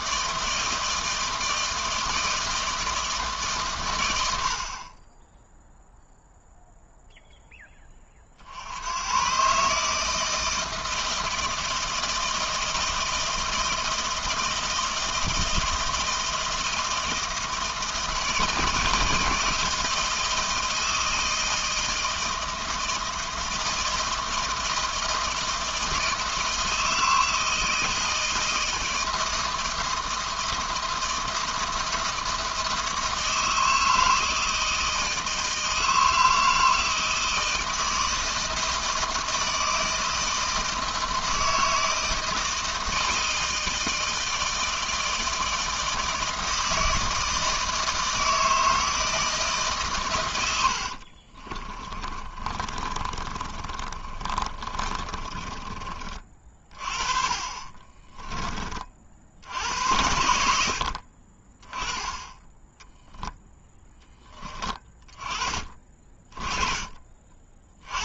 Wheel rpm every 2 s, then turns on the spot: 160, 160, 40, 0, 90, 160, 160, 160, 160, 160, 160, 160, 160, 160, 160, 160, 160, 160, 160, 160, 160, 160, 160, 160, 160, 60, 30, 30, 40, 40, 60, 10, 20, 30.
50-56